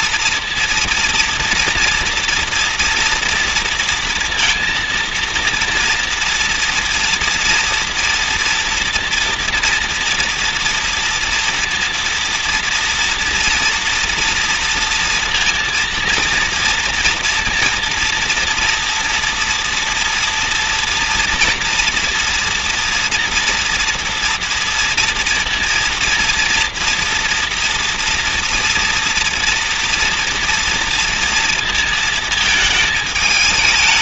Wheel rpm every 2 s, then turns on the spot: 230, 230, 230, 230, 230, 230, 230, 230, 230, 230, 230, 230, 230, 230, 230, 230, 220.
none